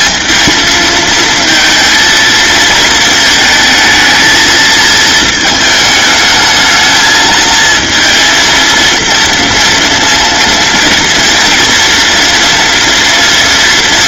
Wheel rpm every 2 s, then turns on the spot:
230, 230, 220, 220, 230, 230, 230.
none